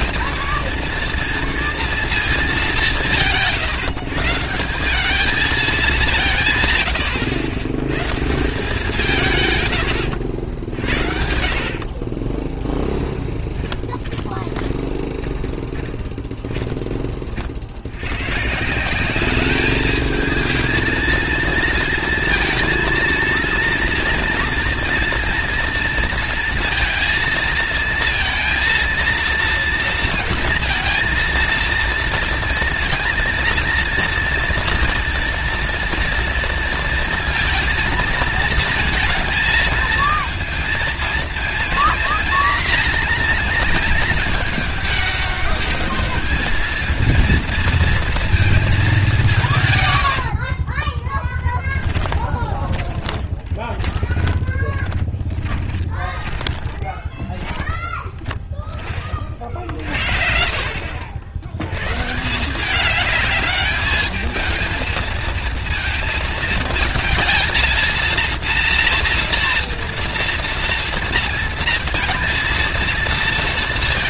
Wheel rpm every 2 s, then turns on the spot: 220, 210, 160, 130, 150, 70, 10, 20, 20, 160, 220, 230, 230, 230, 230, 220, 230, 230, 230, 220, 230, 240, 220, 220, 220, 50, 20, 20, 20, 20, 60, 180, 220, 230, 230, 230, 230.
12-16 50-58